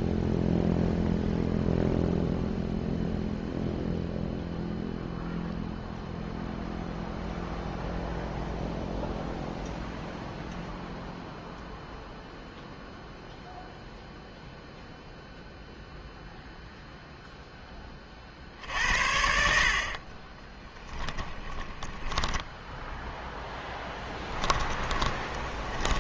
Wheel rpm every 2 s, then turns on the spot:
0, 0, 0, 0, 0, 0, 0, 0, 0, 60, 20, 10, 10.
20-26